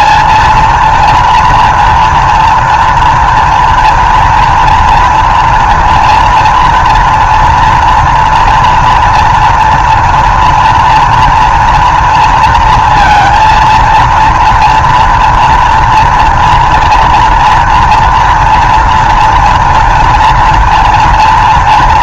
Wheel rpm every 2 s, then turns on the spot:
230, 230, 230, 230, 240, 230, 230, 230, 230, 230, 230.
none